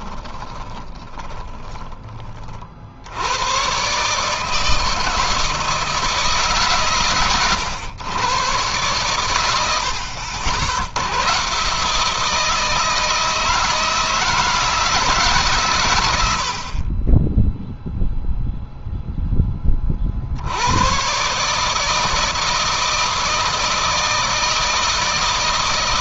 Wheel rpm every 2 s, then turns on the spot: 20, 60, 160, 140, 120, 80, 160, 160, 40, 0, 100, 160, 160.
0-2